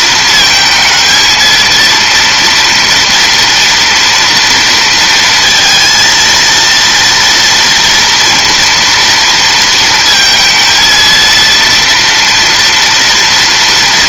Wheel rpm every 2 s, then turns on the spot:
220, 230, 230, 230, 230, 220, 230.
none